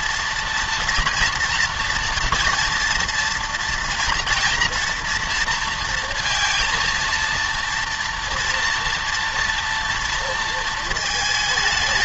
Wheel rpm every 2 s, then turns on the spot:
240, 230, 230, 230, 230, 220.
none